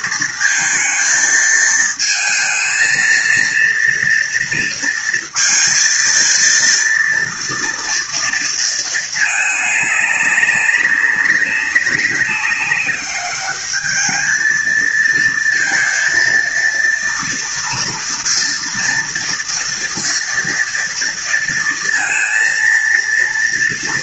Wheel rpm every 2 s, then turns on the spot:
220, 220, 230, 230, 220, 200, 200, 230, 230, 230, 230, 230.
none